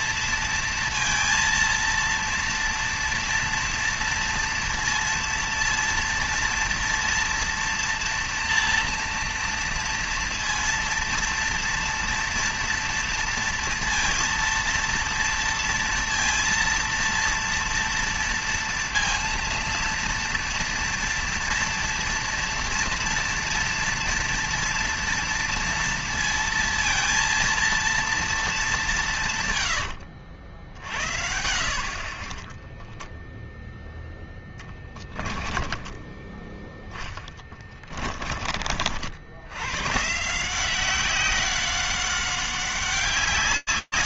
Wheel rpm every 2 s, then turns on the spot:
230, 230, 230, 230, 240, 230, 230, 230, 230, 230, 230, 240, 230, 230, 220, 80, 30, 10, 20, 30, 150, 190.
32-38